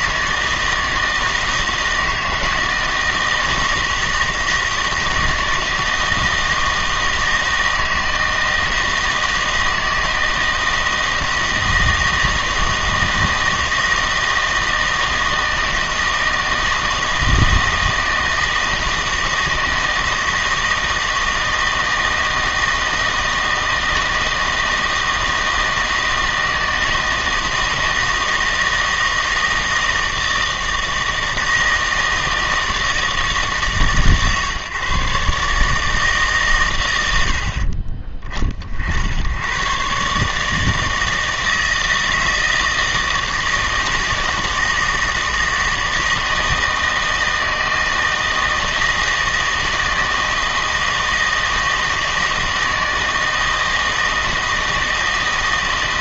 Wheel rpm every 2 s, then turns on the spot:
160, 160, 160, 160, 160, 160, 160, 160, 160, 160, 160, 160, 160, 160, 160, 160, 160, 140, 100, 60, 160, 160, 160, 160, 160, 160, 160, 160.
none